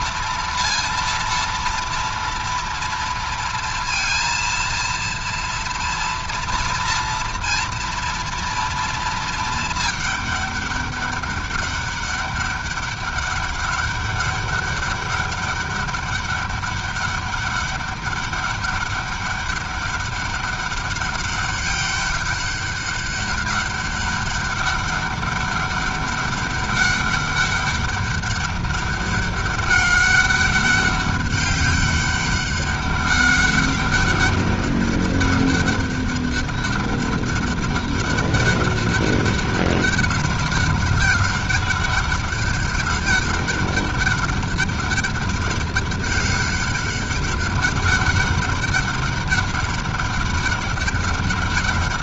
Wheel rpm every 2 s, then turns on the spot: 230, 230, 230, 230, 230, 200, 200, 200, 200, 200, 200, 200, 200, 200, 200, 200, 200, 200, 200, 200, 200, 200, 200, 200, 200, 200.
none